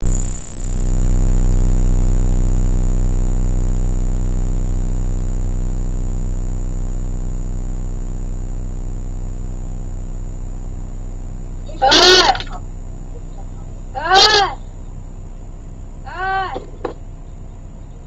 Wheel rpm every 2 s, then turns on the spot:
0, 0, 0, 0, 0, 0, 0, 0, 0.
none